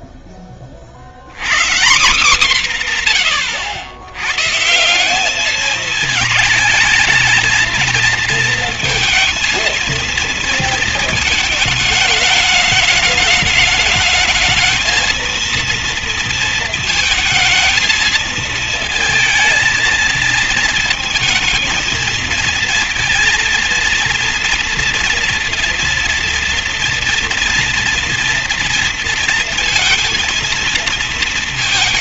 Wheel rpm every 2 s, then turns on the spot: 30, 200, 150, 230, 230, 230, 210, 220, 230, 220, 230, 230, 240, 230, 230, 230.
none